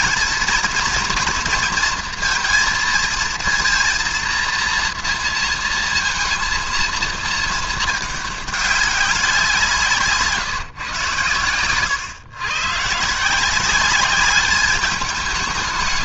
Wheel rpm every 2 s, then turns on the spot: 230, 230, 230, 230, 200, 150, 120, 200.
none